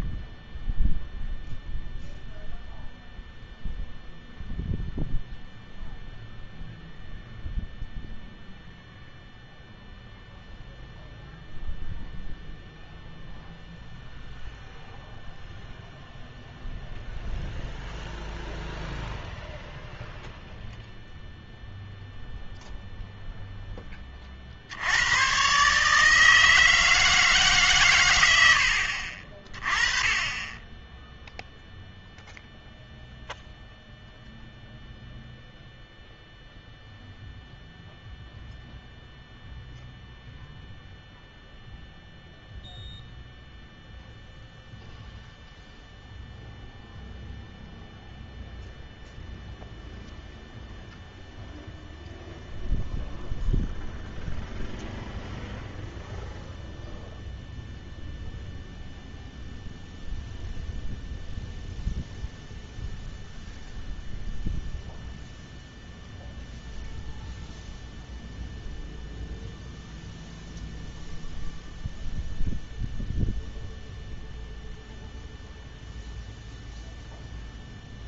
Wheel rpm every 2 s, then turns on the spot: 0, 0, 0, 0, 0, 0, 0, 0, 0, 0, 0, 0, 60, 160, 80, 10, 0, 0, 0, 0, 0, 0, 0, 0, 0, 0, 0, 0, 0, 0, 0, 0, 0, 0, 0, 0, 0, 0, 0.
none